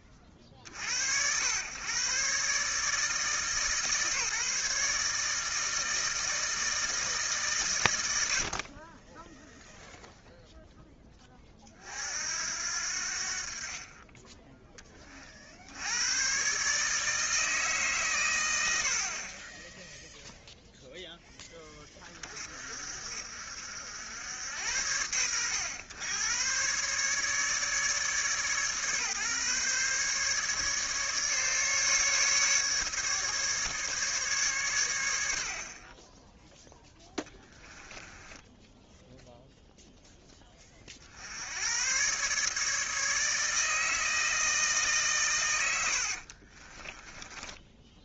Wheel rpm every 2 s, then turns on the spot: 30, 150, 150, 160, 40, 10, 70, 20, 150, 60, 10, 50, 80, 130, 140, 150, 150, 120, 10, 10, 40, 150, 150, 30.
38-40 46-48